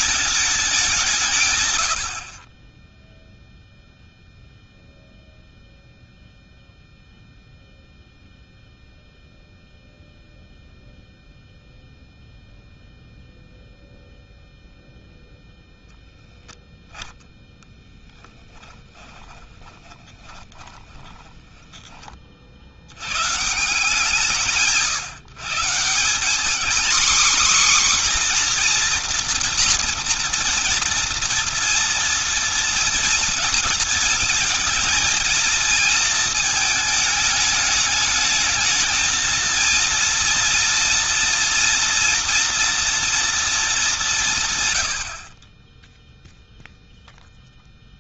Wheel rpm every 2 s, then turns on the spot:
180, 10, 0, 0, 0, 0, 0, 0, 10, 20, 20, 70, 160, 240, 250, 230, 230, 230, 220, 220, 230, 230, 110, 0.
18-22